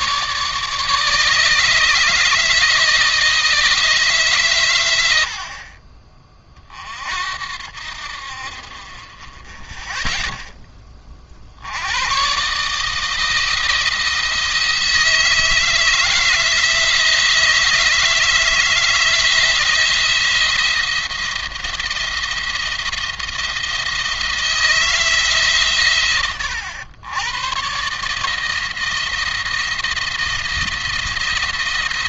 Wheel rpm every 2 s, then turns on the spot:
150, 150, 110, 40, 50, 20, 140, 170, 160, 160, 170, 170, 160, 100, 160, 170.
none